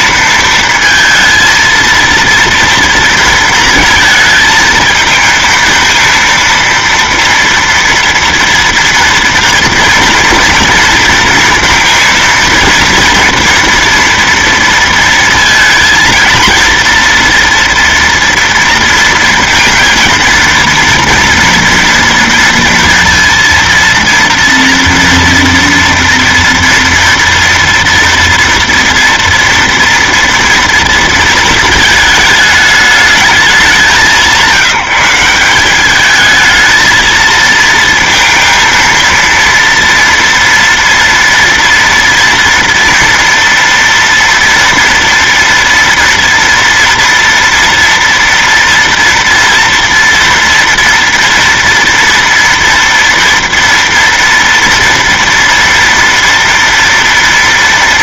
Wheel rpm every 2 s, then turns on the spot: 230, 230, 220, 230, 240, 230, 230, 230, 230, 230, 230, 230, 230, 230, 230, 230, 210, 180, 220, 230, 230, 230, 230, 230, 230, 230, 230, 230, 230.
none